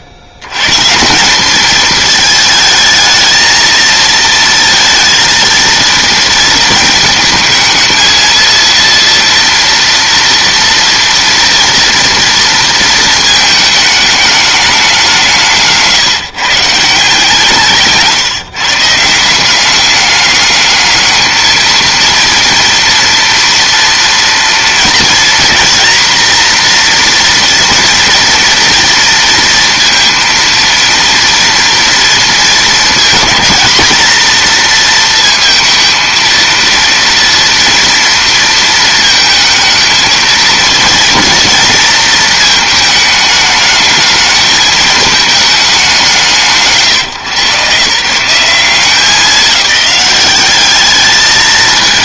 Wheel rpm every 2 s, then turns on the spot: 110, 220, 230, 220, 230, 230, 230, 210, 150, 150, 210, 230, 230, 240, 230, 230, 220, 230, 230, 230, 230, 220, 220, 120, 190, 200.
none